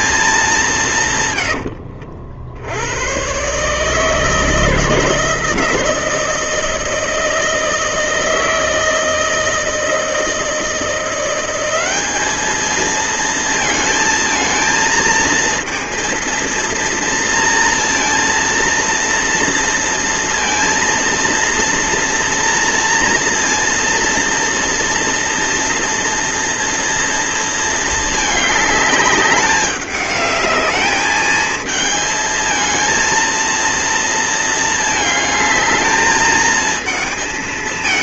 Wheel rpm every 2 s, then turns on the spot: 200, 80, 160, 170, 160, 170, 210, 220, 230, 230, 230, 230, 230, 230, 210, 210, 220, 230, 220.
none